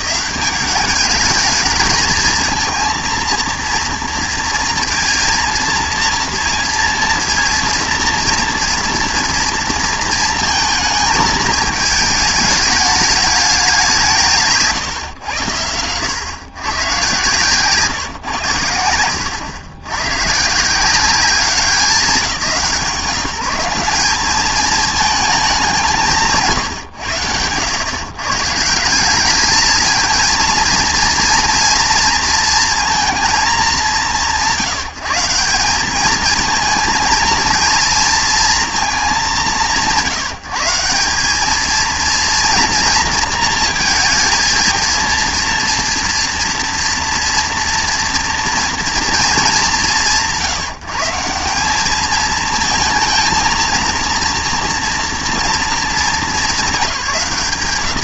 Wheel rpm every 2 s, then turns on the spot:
190, 230, 230, 230, 230, 220, 210, 140, 130, 120, 150, 180, 210, 140, 160, 230, 230, 140, 220, 230, 170, 230, 230, 230, 230, 150, 220, 240, 200.
none